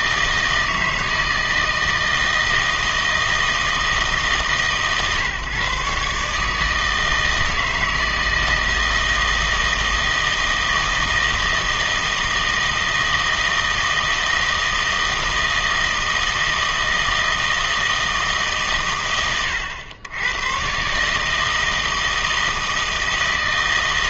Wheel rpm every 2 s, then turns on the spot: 160, 160, 140, 160, 160, 160, 160, 160, 160, 140, 130, 160.
none